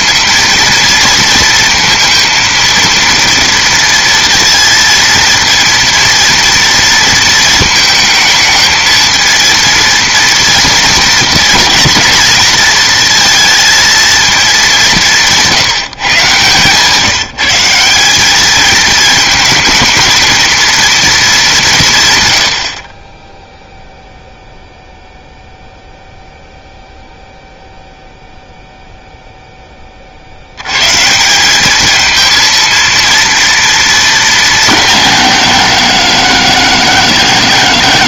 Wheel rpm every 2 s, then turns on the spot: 230, 230, 230, 230, 220, 230, 230, 200, 140, 210, 230, 60, 0, 0, 0, 110, 230, 200, 150.
none